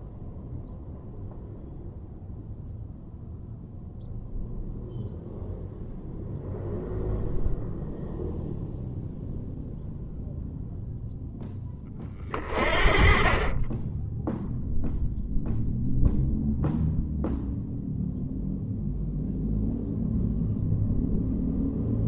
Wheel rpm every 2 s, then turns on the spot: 0, 0, 0, 0, 0, 0, 30, 0, 0, 0, 0.
none